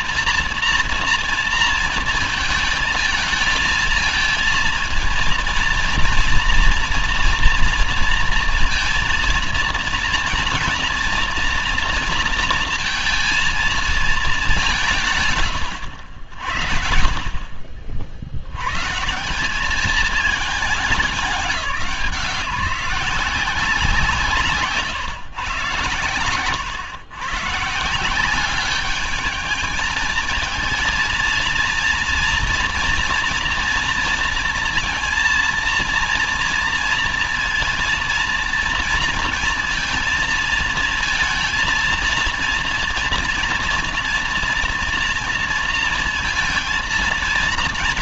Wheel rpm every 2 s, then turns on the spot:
230, 220, 230, 230, 230, 230, 230, 140, 50, 180, 170, 180, 130, 130, 210, 230, 230, 230, 230, 230, 230, 240, 240, 230.
none